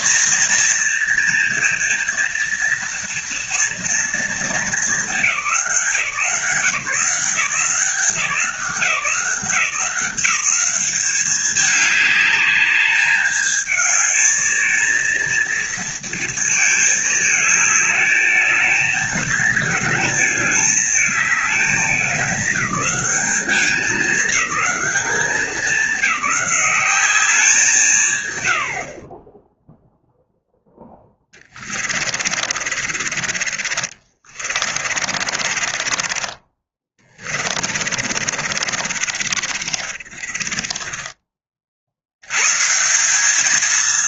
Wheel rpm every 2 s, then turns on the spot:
240, 240, 200, 170, 170, 190, 210, 230, 220, 220, 220, 190, 200, 200, 60, 10, 40, 40, 30, 40, 30, 170.
30-42